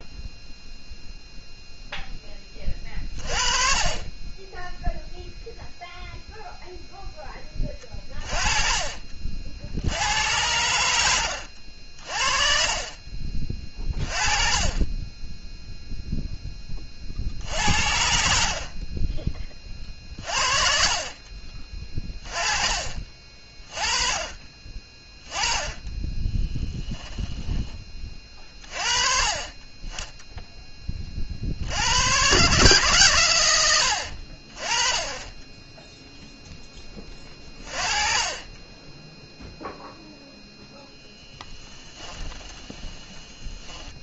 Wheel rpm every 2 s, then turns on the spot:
0, 30, 10, 0, 30, 90, 40, 30, 20, 50, 40, 30, 30, 10, 30, 20, 150, 40, 20, 20, 0, 20.
26-28 42-44